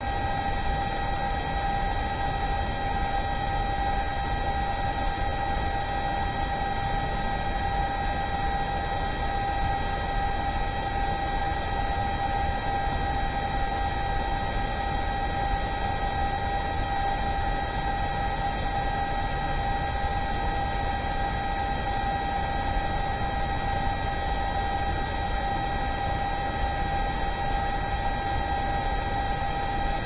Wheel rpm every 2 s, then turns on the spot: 0, 0, 0, 0, 0, 0, 0, 0, 0, 0, 0, 0, 0, 0, 0.
none